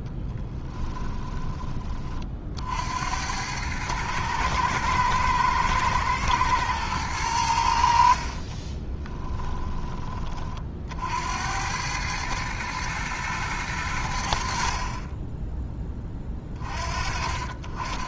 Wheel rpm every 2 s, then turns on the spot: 20, 80, 110, 110, 20, 60, 110, 40, 40.
0-2 8-10 14-16